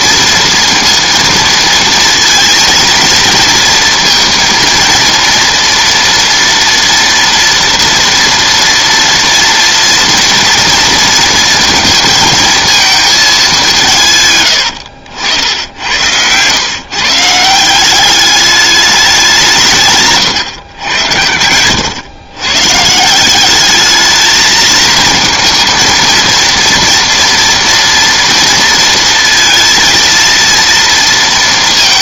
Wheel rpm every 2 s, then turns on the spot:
230, 230, 230, 230, 230, 230, 220, 110, 110, 200, 110, 130, 220, 230, 230, 230.
none